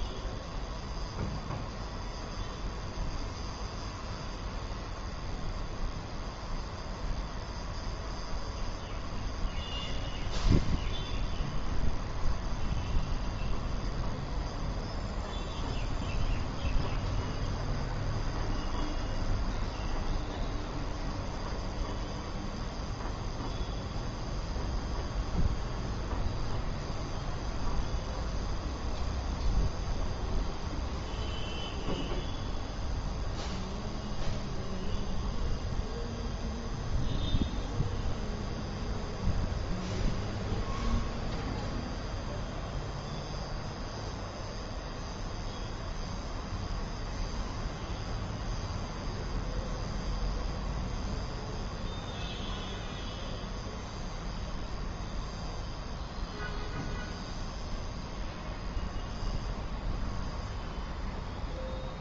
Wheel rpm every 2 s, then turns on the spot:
0, 0, 0, 0, 0, 0, 0, 0, 0, 0, 0, 0, 0, 0, 0, 0, 0, 0, 0, 0, 0, 0, 0, 0, 0, 0, 0, 0, 0, 0, 0.
none